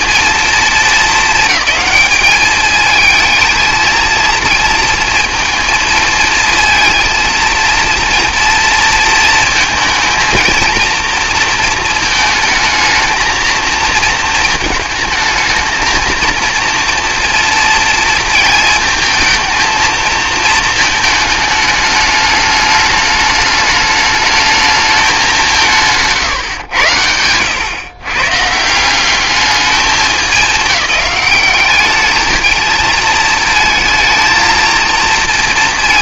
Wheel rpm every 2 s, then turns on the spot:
220, 220, 230, 230, 230, 230, 220, 220, 230, 220, 220, 210, 210, 100, 170, 190, 220, 230.
none